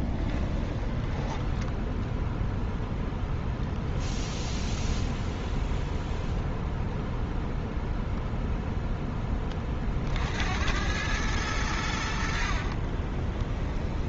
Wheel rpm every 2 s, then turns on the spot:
10, 0, 0, 0, 0, 80, 60.
0-2 12-14